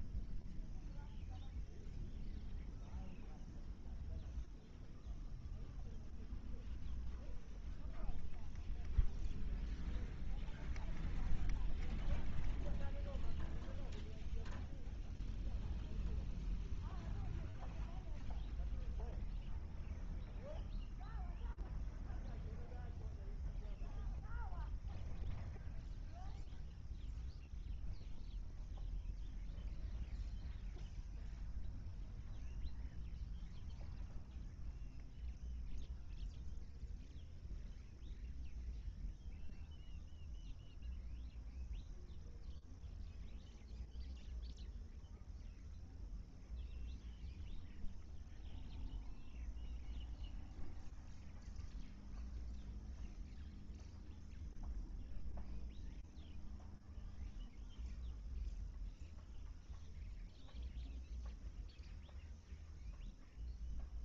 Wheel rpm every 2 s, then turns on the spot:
0, 0, 0, 0, 0, 0, 0, 0, 0, 0, 0, 0, 0, 0, 0, 0, 0, 0, 0, 0, 0, 0, 0, 0, 0, 0, 0, 0, 0, 0, 0, 0.
none